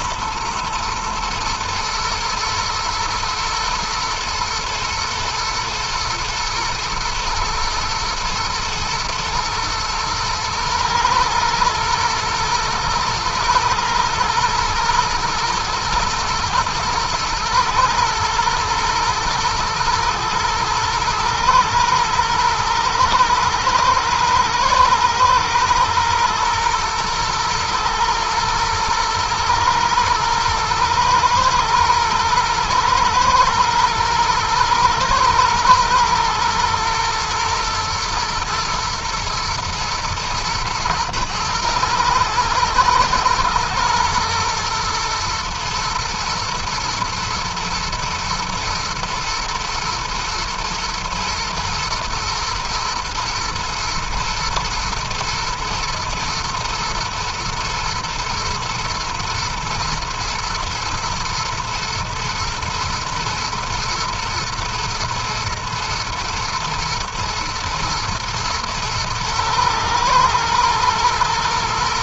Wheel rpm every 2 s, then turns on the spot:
120, 120, 110, 110, 110, 120, 120, 120, 120, 110, 110, 110, 110, 110, 110, 120, 120, 120, 120, 120, 110, 120, 120, 110, 120, 120, 110, 110, 110, 110, 120, 110, 110, 110, 110, 110.
none